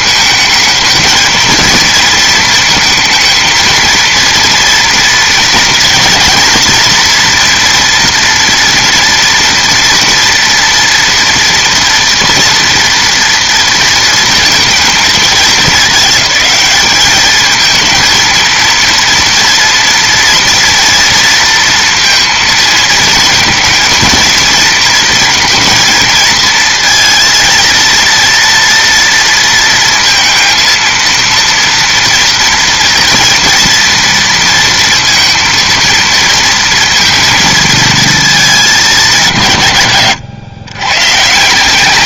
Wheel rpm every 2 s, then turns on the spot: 220, 230, 230, 230, 230, 230, 230, 220, 210, 230, 230, 220, 230, 230, 230, 230, 240, 230, 230, 210, 120.
none